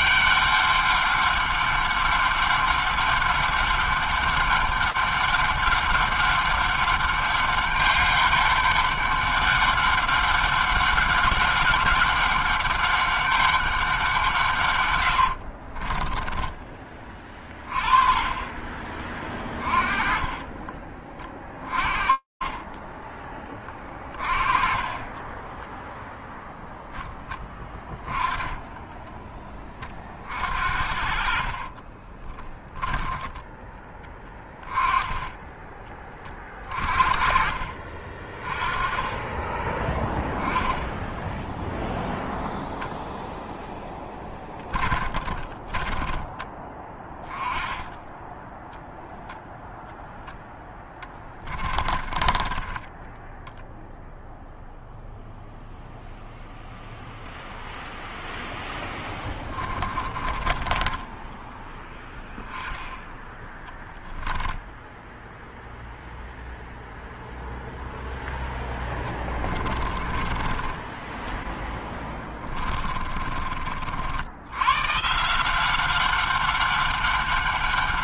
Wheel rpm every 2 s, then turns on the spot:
200, 200, 200, 200, 200, 200, 200, 160, 20, 30, 20, 20, 20, 0, 20, 50, 30, 10, 20, 30, 10, 0, 10, 20, 10, 0, 30, 0, 0, 0, 30, 10, 10, 0, 0, 20, 10, 90, 200.
16-18 20-24 32-34 44-46 52-54 60-62 64-66 72-74